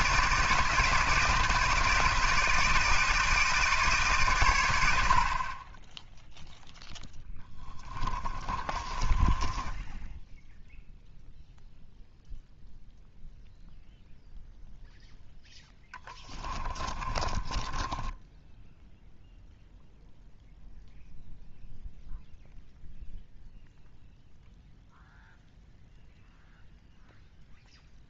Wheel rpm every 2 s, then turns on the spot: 160, 160, 100, 0, 20, 0, 0, 0, 30, 0, 0, 0, 0, 0.
8-10 16-18